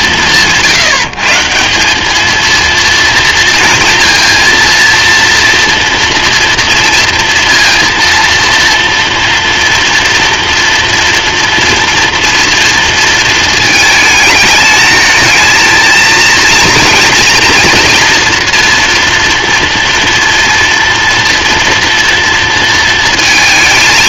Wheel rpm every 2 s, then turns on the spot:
150, 230, 230, 230, 240, 230, 220, 220, 230, 230, 230, 230.
none